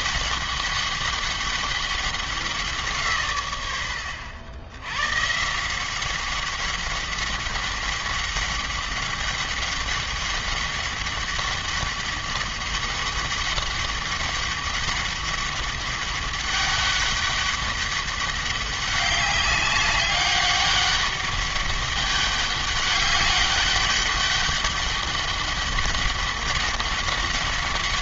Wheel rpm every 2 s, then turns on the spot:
200, 180, 100, 190, 200, 200, 200, 200, 200, 200, 200, 200, 200, 190.
none